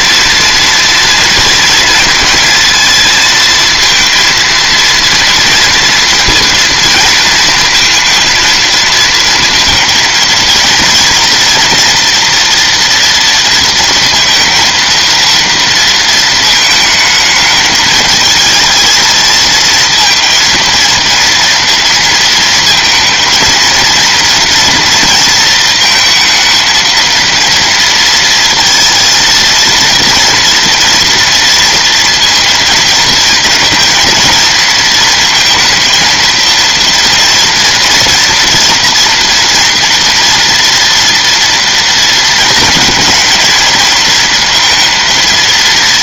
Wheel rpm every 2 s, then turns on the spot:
230, 230, 230, 230, 230, 230, 230, 230, 220, 220, 230, 230, 230, 230, 230, 230, 230, 230, 230, 230, 240, 230, 230.
none